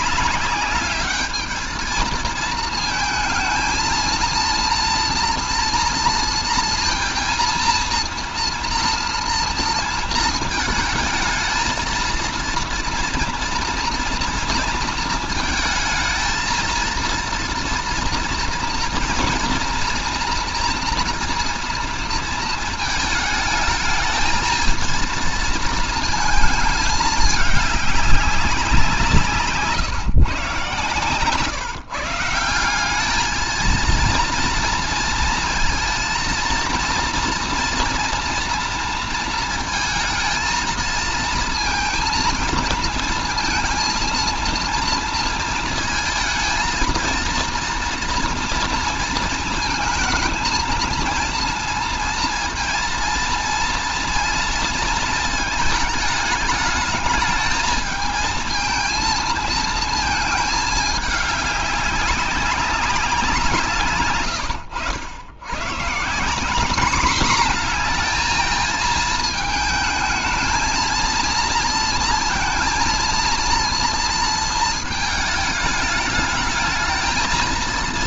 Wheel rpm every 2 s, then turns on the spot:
200, 220, 230, 230, 230, 220, 240, 230, 230, 230, 230, 220, 230, 210, 170, 130, 180, 230, 230, 230, 220, 230, 230, 230, 230, 230, 230, 230, 210, 220, 210, 190, 90, 210, 230, 230, 230, 220, 220.
none